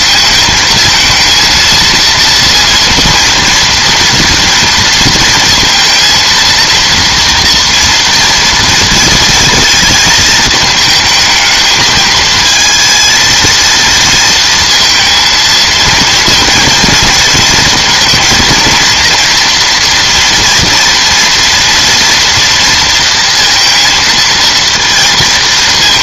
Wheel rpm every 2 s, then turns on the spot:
220, 230, 230, 230, 230, 220, 220, 230, 230, 230, 240, 230, 230.
none